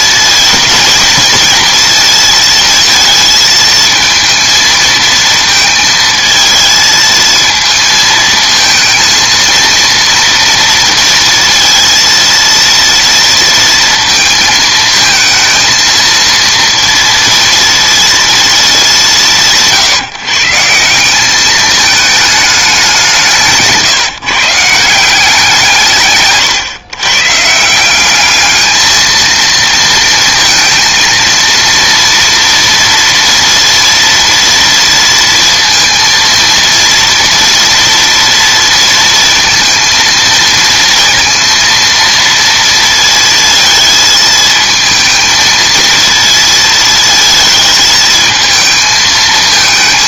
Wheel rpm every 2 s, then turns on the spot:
230, 230, 220, 230, 230, 230, 230, 230, 230, 200, 160, 200, 160, 130, 210, 230, 230, 230, 230, 230, 230, 230, 220, 230, 220.
none